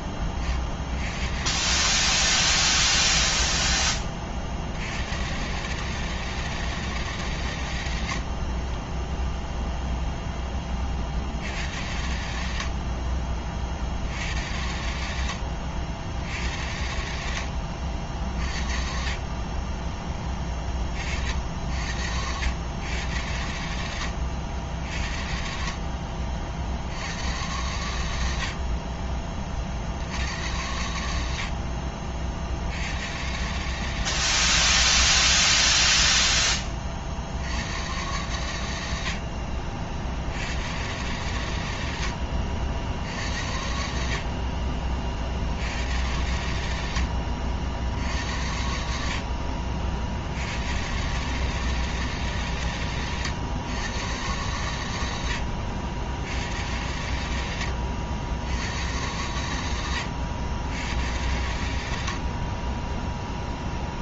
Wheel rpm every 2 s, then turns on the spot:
40, 20, 50, 160, 40, 10, 70, 80, 80, 40, 20, 90, 70, 60, 60, 90, 60, 120, 20, 90, 90, 70, 40, 90, 70, 90, 140, 110, 90, 90, 90, 30.
8-10